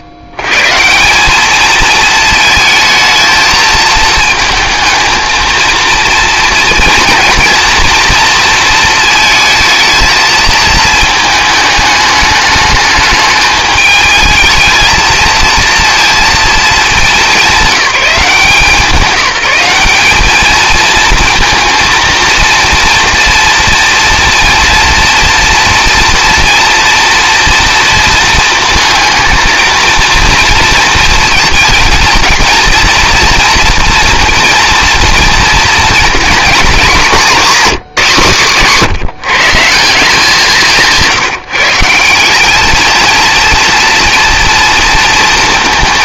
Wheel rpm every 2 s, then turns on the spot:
120, 220, 220, 230, 230, 220, 210, 220, 230, 190, 220, 230, 230, 240, 220, 230, 230, 230, 230, 160, 180, 210, 230.
none